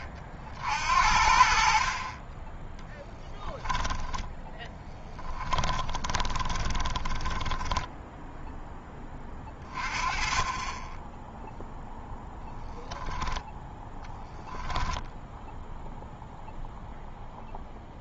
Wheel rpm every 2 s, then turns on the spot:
60, 10, 10, 20, 10, 20, 10, 0, 0.
4-8